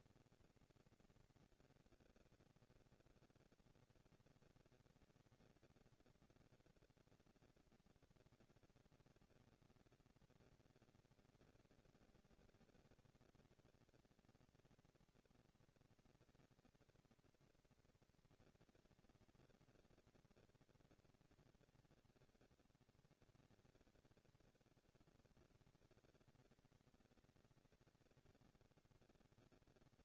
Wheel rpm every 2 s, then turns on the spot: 230, 230, 230, 230, 230, 230, 230, 230, 230, 230, 230, 210, 200, 200, 210.
none